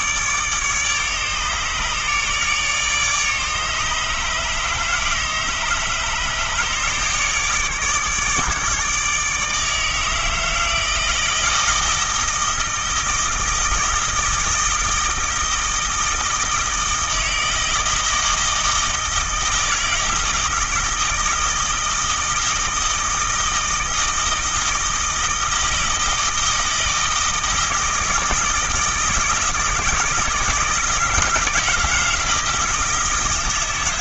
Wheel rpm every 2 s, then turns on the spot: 150, 150, 150, 150, 150, 160, 160, 160, 160, 160, 160, 160, 160, 160, 160, 160, 160.
none